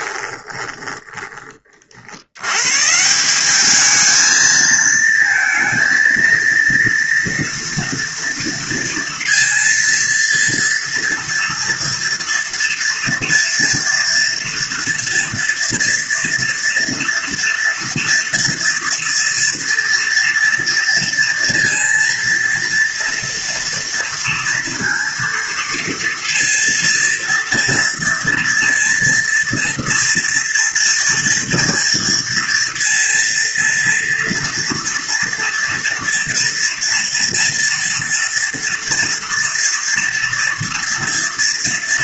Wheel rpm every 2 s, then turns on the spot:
20, 170, 230, 230, 230, 230, 240, 230, 230, 230, 230, 230, 230, 230, 230, 230, 230, 240, 230, 230, 230.
0-2